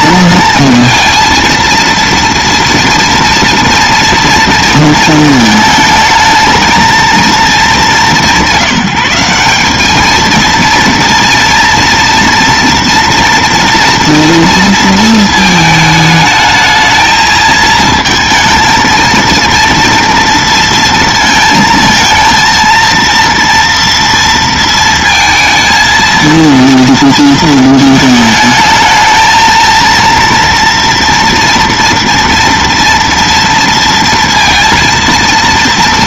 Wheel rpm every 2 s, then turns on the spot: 230, 230, 230, 220, 180, 230, 240, 230, 220, 230, 230, 230, 230, 230, 220, 230, 230, 230.
none